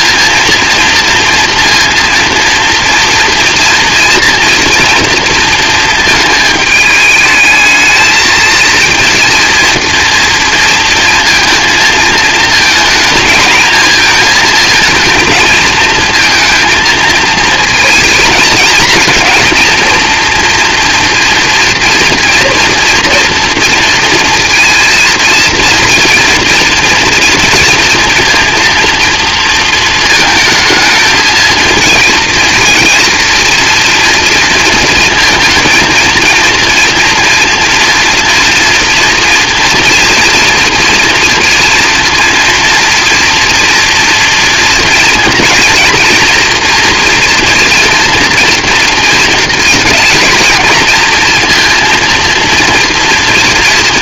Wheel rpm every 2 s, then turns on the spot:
230, 230, 230, 210, 230, 230, 220, 230, 230, 230, 230, 230, 230, 230, 230, 220, 230, 230, 230, 230, 230, 240, 240, 230, 230, 230, 240.
none